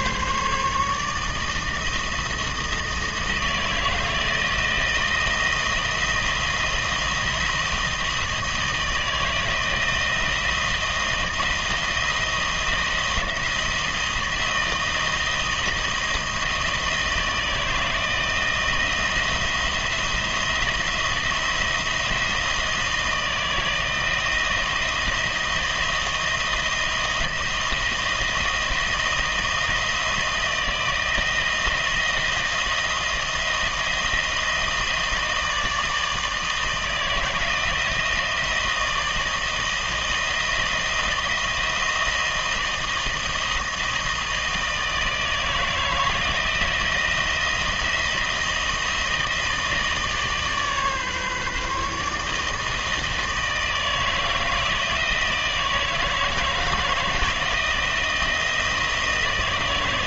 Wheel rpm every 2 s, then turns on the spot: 160, 160, 170, 160, 160, 170, 170, 160, 160, 170, 170, 160, 160, 160, 160, 160, 170, 160, 160, 160, 160, 160, 160, 170, 160, 140, 160, 160, 160, 160.
none